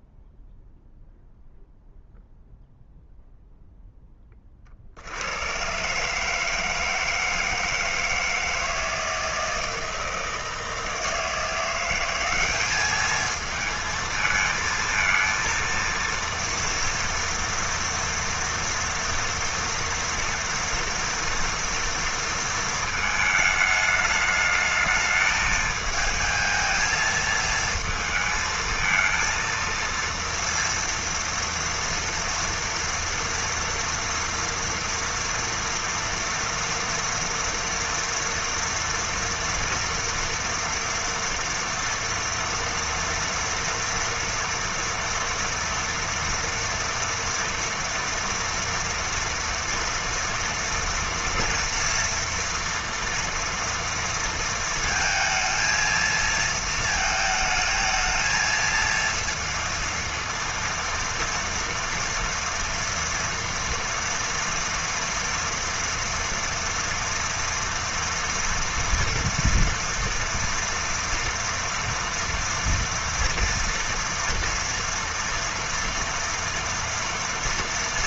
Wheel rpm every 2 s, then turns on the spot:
0, 0, 60, 160, 160, 160, 210, 230, 230, 230, 230, 230, 220, 220, 220, 230, 230, 230, 230, 230, 230, 230, 230, 230, 240, 240, 240, 230, 220, 230, 230, 230, 230, 240, 230, 230, 230, 230, 230.
none